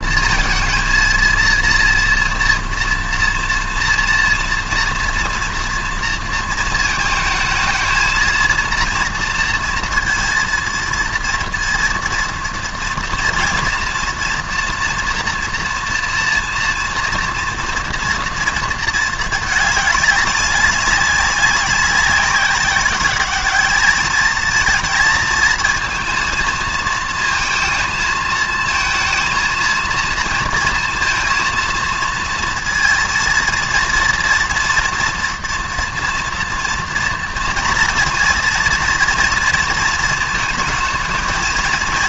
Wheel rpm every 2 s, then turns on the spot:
230, 230, 230, 220, 230, 230, 230, 230, 230, 220, 200, 200, 230, 230, 230, 230, 230, 230, 230, 240, 220.
none